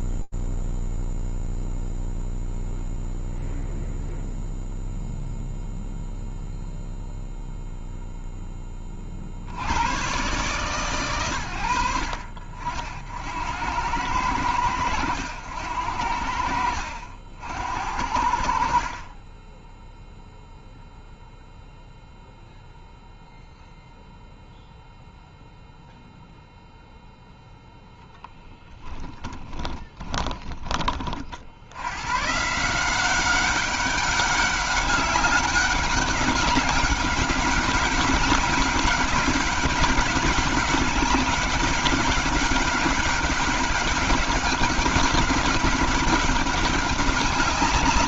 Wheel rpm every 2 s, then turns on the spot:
0, 0, 0, 50, 110, 80, 80, 70, 40, 0, 0, 0, 0, 30, 30, 170, 200, 200, 200, 200, 200, 200, 200, 200.
26-28